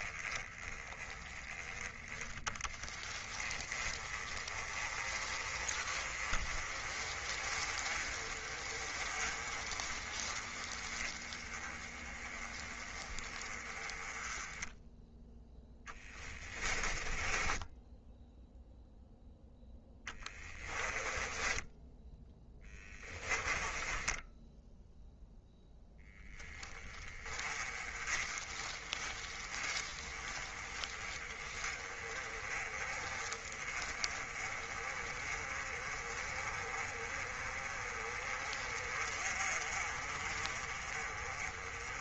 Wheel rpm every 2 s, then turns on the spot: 10, 20, 30, 30, 30, 20, 20, 10, 20, 0, 10, 10, 0, 10, 20, 20, 20, 30, 30, 30, 30.
16-18 20-24